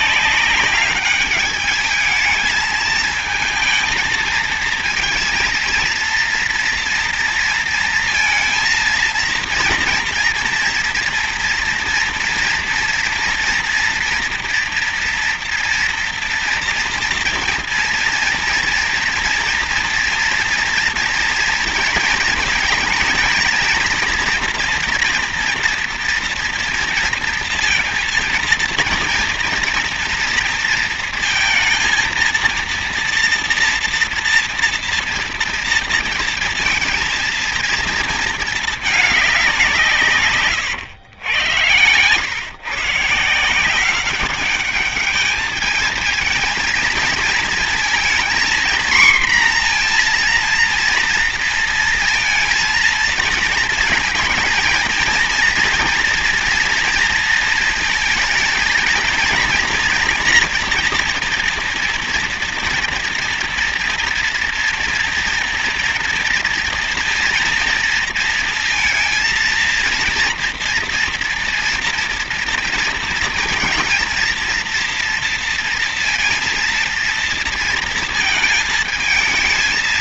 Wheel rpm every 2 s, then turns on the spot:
200, 220, 230, 240, 230, 230, 230, 240, 230, 230, 240, 230, 240, 230, 230, 230, 230, 230, 230, 220, 110, 130, 200, 220, 230, 230, 230, 230, 230, 230, 240, 230, 230, 230, 230, 230, 230, 230, 230, 220.
none